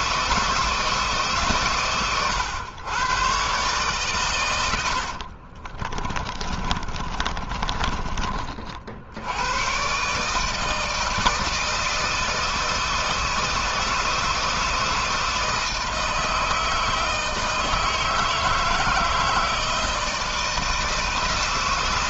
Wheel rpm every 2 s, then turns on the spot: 160, 120, 80, 30, 80, 160, 160, 160, 160, 160, 160.
4-8